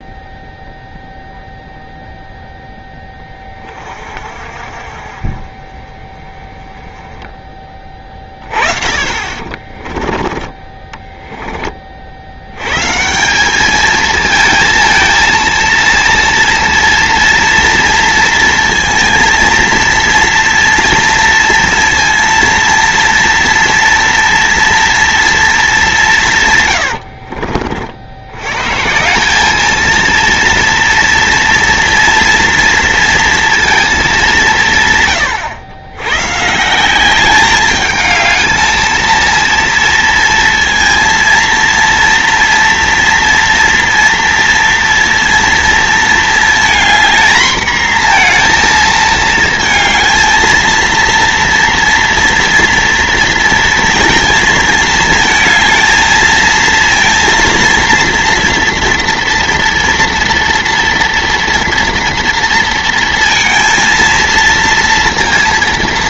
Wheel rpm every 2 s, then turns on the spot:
0, 0, 40, 20, 30, 20, 90, 220, 230, 230, 230, 230, 230, 140, 110, 230, 230, 180, 150, 220, 230, 240, 230, 230, 230, 230, 230, 220, 220, 230, 230, 230, 230.
10-12 26-28